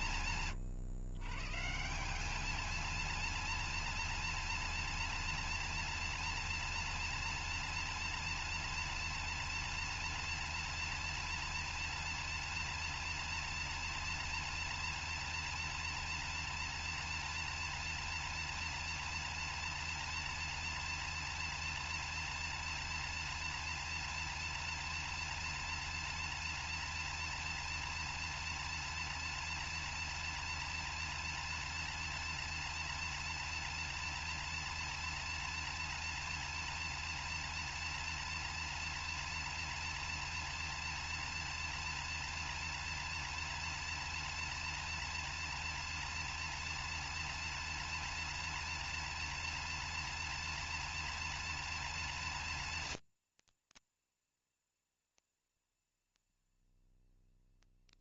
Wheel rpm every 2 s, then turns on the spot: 140, 230, 230, 230, 230, 230, 240, 240, 230, 230, 230, 230, 240, 230, 230, 230, 230, 230, 230, 230, 230, 240, 240, 230, 230, 230, 230, 230, 240.
none